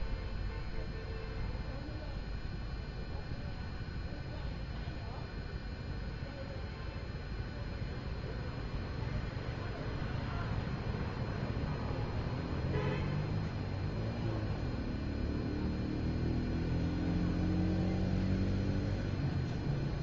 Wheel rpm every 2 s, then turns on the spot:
0, 0, 0, 0, 0, 0, 0, 0, 0, 0.
none